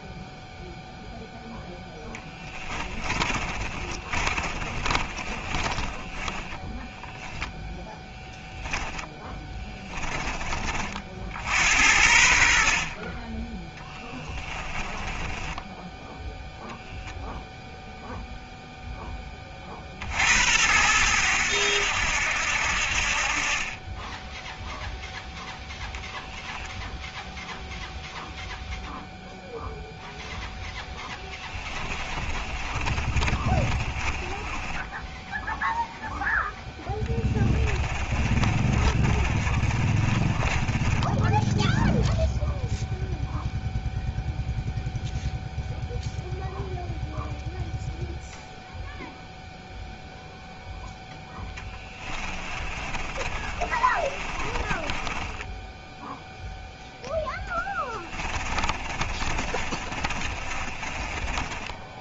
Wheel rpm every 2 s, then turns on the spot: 0, 20, 30, 10, 10, 40, 40, 20, 0, 10, 90, 60, 0, 0, 0, 10, 30, 10, 10, 30, 10, 0, 0, 0, 0, 0, 30, 30, 0, 30, 20.
2-6 8-10 14-16 30-42 52-56 58-62